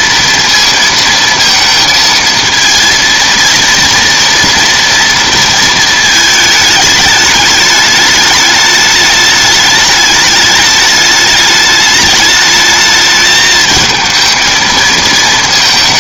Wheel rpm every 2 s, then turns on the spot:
230, 230, 230, 220, 210, 210, 210, 220.
none